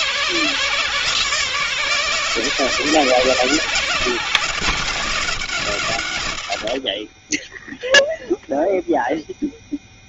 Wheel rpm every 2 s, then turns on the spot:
140, 140, 120, 30, 0.
none